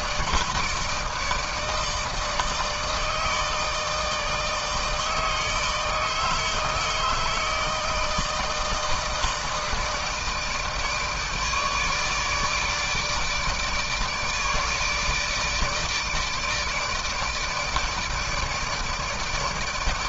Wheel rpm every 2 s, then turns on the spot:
160, 160, 160, 160, 160, 160, 150, 150, 160, 160.
none